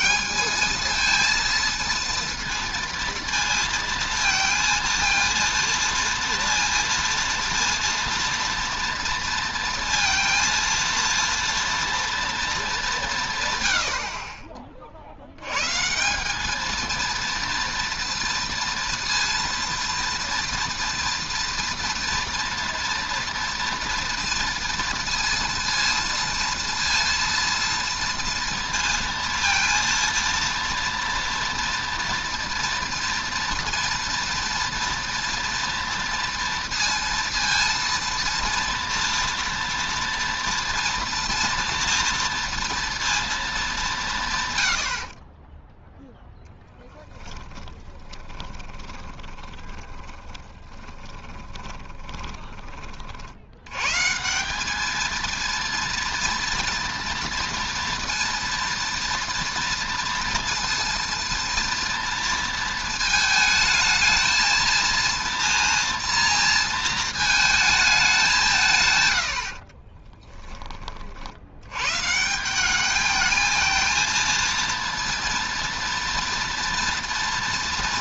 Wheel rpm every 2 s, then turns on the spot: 220, 230, 230, 230, 230, 230, 200, 40, 220, 230, 230, 230, 230, 230, 230, 240, 240, 230, 230, 230, 230, 230, 90, 10, 30, 20, 20, 200, 230, 230, 230, 230, 220, 230, 160, 20, 200, 230, 230.
46-52